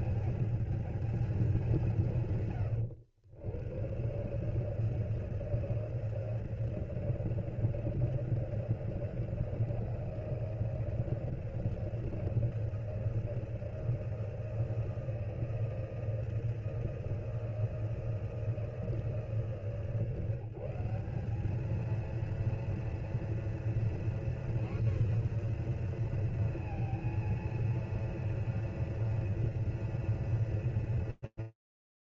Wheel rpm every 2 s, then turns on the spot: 220, 120, 150, 160, 160, 160, 160, 160, 160, 160, 160, 230, 250, 230, 240, 230.
none